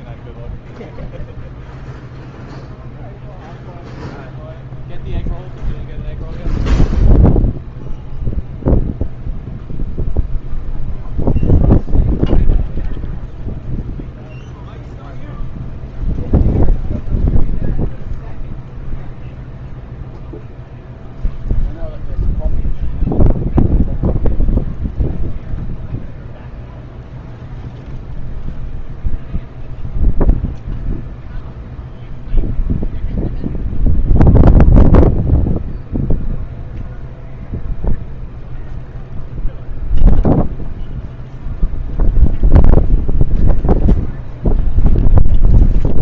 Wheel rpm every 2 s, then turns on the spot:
0, 0, 0, 0, 0, 0, 0, 0, 0, 0, 0, 0, 0, 0, 0, 0, 0, 0, 0, 0, 0, 0, 0.
none